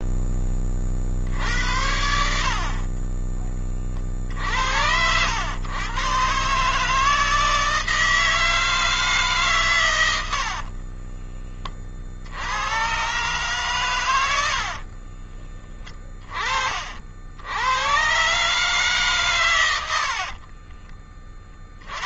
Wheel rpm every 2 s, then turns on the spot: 20, 60, 60, 140, 160, 70, 80, 70, 30, 140, 50.
10-12 14-16 20-22